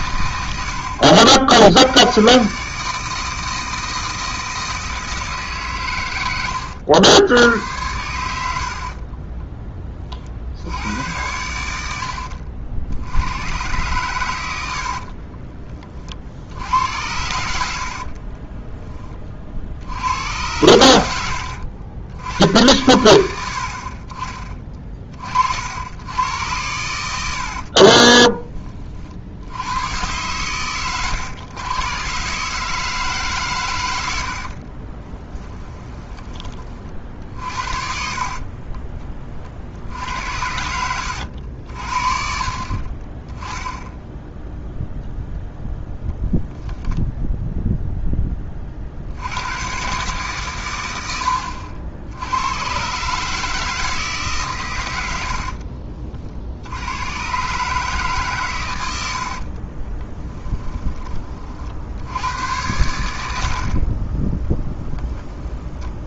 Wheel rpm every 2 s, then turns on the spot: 60, 150, 160, 90, 60, 80, 60, 80, 80, 10, 110, 90, 30, 100, 30, 120, 150, 30, 30, 30, 90, 50, 0, 0, 40, 110, 120, 110, 70, 100, 10, 100, 10.
8-10 14-16 18-20 34-36 38-42